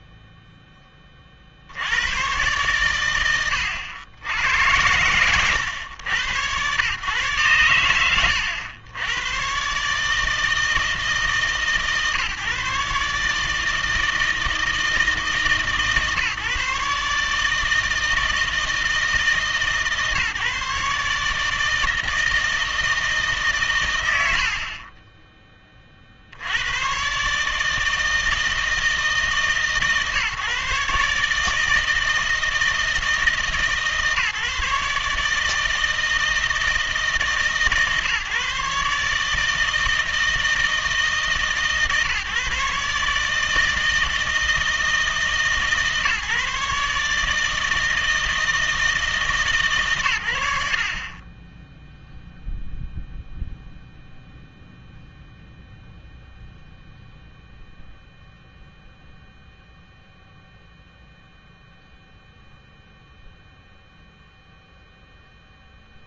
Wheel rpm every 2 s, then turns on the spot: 0, 120, 90, 110, 90, 160, 140, 160, 140, 160, 150, 160, 80, 90, 160, 140, 160, 150, 160, 150, 160, 140, 160, 140, 160, 70, 0, 0, 0, 0, 0, 0, 0.
none